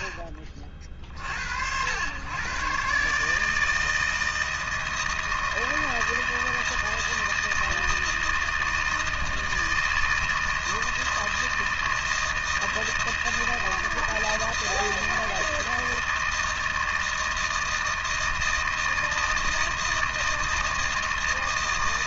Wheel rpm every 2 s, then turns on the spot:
40, 150, 160, 160, 160, 160, 160, 160, 160, 160, 160.
none